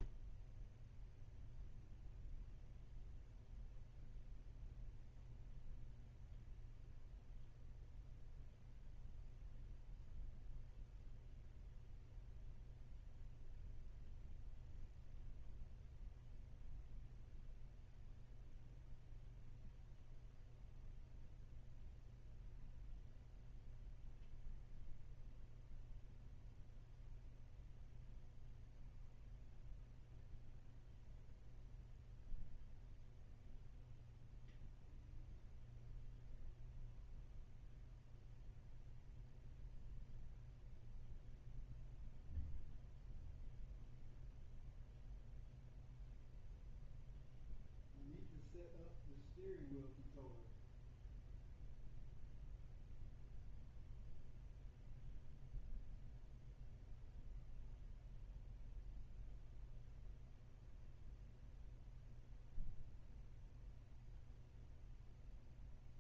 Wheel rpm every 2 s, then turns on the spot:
0, 0, 0, 0, 0, 0, 0, 0, 0, 0, 0, 0, 0, 0, 0, 0, 0, 0, 0, 0, 0, 0, 0, 0, 0, 0, 0, 0, 0, 0, 0, 0, 0.
none